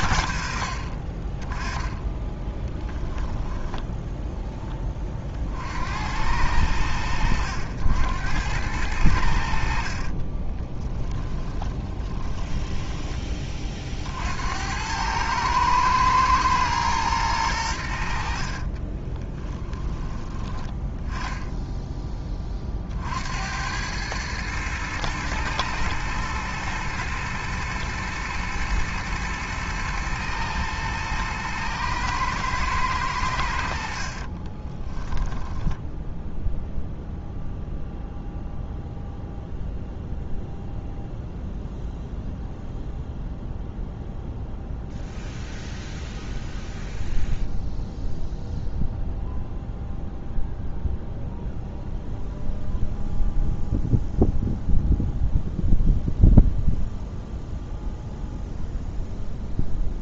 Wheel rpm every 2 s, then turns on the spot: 70, 10, 10, 90, 90, 40, 10, 70, 110, 60, 10, 20, 110, 120, 110, 110, 110, 40, 0, 0, 0, 0, 0, 0, 0, 0, 0, 0, 0, 0.
10-14 18-20 34-36